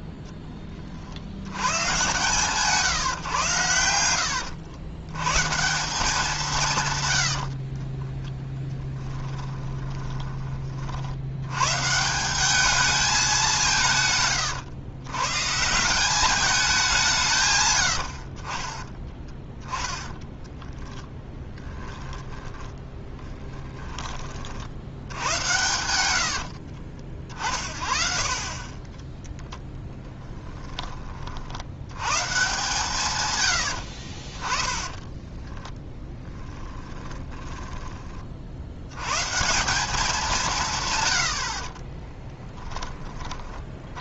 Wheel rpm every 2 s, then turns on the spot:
20, 150, 90, 170, 10, 30, 200, 120, 210, 40, 10, 10, 60, 70, 40, 10, 140, 20, 10, 60, 160, 10.
8-10 20-24 26-28 34-38 42-44